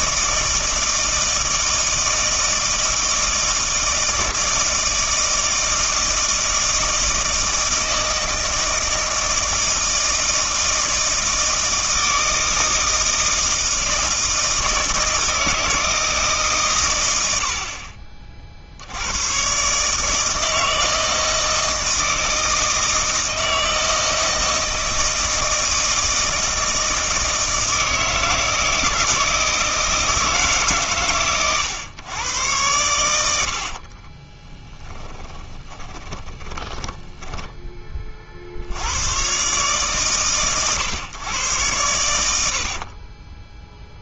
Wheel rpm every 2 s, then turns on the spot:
160, 160, 160, 160, 160, 160, 160, 160, 140, 60, 160, 160, 160, 160, 160, 140, 100, 20, 20, 70, 120, 60.
34-38 42-44